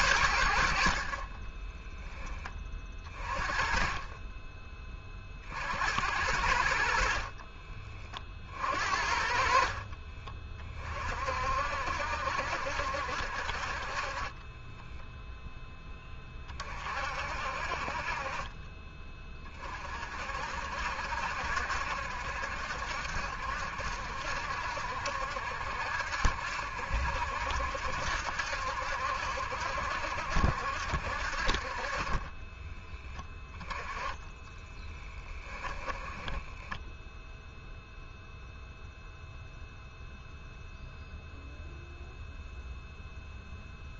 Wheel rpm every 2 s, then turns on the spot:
80, 30, 20, 70, 50, 30, 70, 20, 40, 30, 60, 60, 60, 70, 70, 70, 20, 10, 10, 0, 0, 0.
14-16 32-38